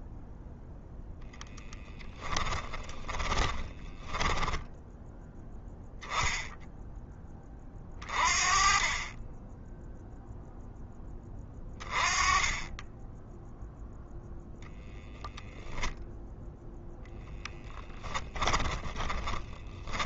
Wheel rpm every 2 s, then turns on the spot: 0, 10, 10, 10, 30, 10, 10, 0, 0, 20.
2-4 18-20